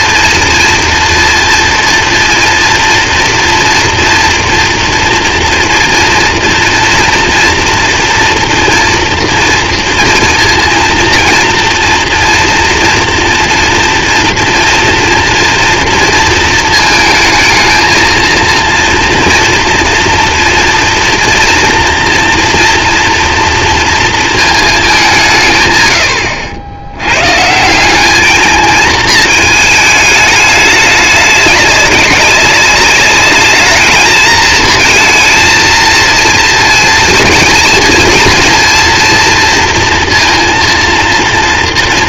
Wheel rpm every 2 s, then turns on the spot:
230, 230, 240, 230, 230, 230, 230, 230, 220, 230, 230, 230, 200, 90, 220, 210, 200, 220, 230, 230, 230.
none